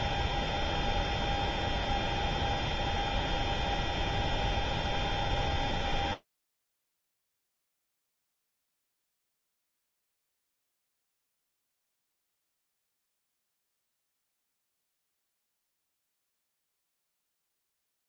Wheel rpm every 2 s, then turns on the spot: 0, 0, 0, 80, 50, 20, 20, 50, 20.
none